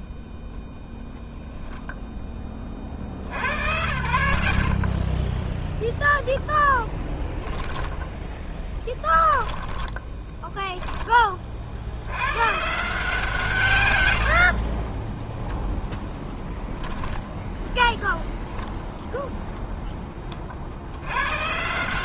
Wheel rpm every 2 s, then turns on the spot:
60, 10, 10, 10, 80, 110, 10, 10, 0, 160, 200.
10-16